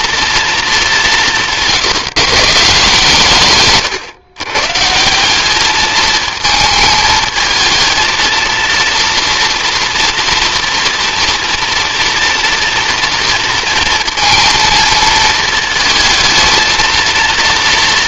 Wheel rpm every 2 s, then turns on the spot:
210, 150, 150, 220, 230, 230, 230, 230, 220.
none